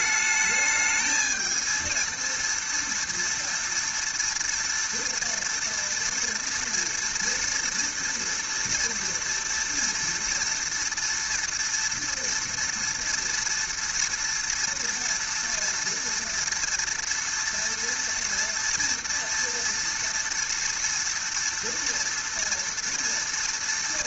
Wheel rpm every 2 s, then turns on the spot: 220, 230, 230, 240, 230, 230, 230, 230, 230, 230, 230, 230.
none